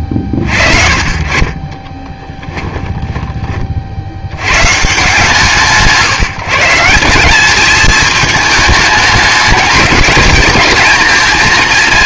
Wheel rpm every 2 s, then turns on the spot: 50, 10, 130, 160, 220, 220.
2-4